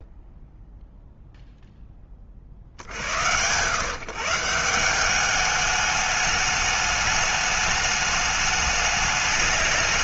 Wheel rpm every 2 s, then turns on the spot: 0, 90, 200, 210, 210.
none